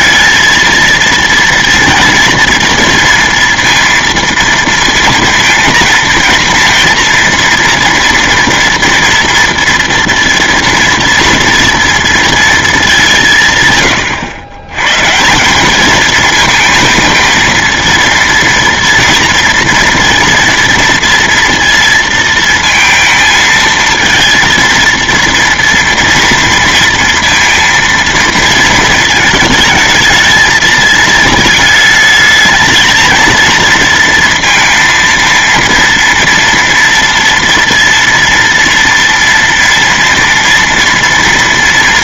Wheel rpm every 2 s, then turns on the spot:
220, 230, 230, 230, 230, 230, 220, 120, 220, 230, 230, 230, 230, 230, 230, 220, 220, 230, 230, 230, 230.
none